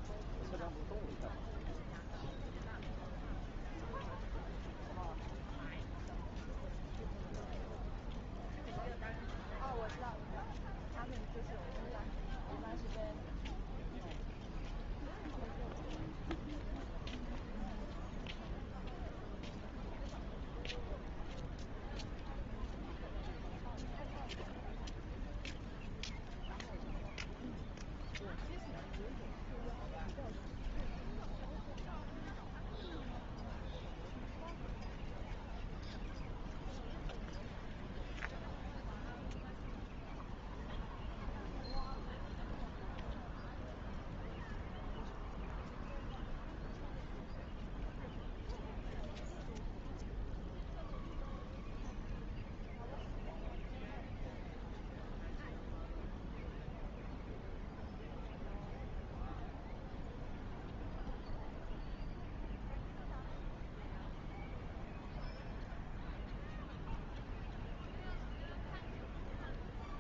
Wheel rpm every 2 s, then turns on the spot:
0, 0, 0, 0, 0, 0, 0, 0, 0, 0, 0, 0, 0, 0, 0, 0, 0, 0, 0, 0, 0, 0, 0, 0, 0, 0, 0, 0, 0, 0, 0, 0, 0, 0, 0.
none